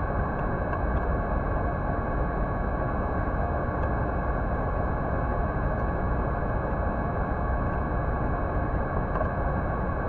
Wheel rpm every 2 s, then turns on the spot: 0, 0, 0, 0, 0.
none